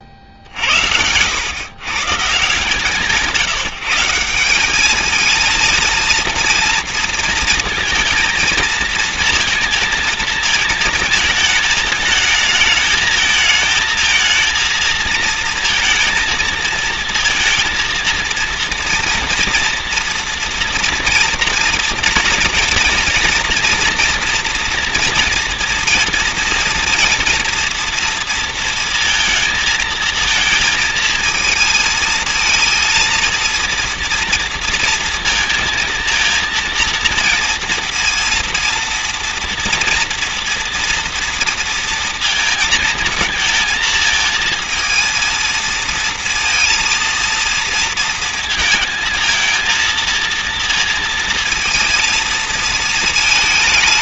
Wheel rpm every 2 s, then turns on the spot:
70, 150, 190, 230, 230, 220, 220, 220, 230, 230, 230, 240, 230, 230, 230, 230, 230, 230, 230, 230, 230, 220, 220, 230, 230, 230, 220.
none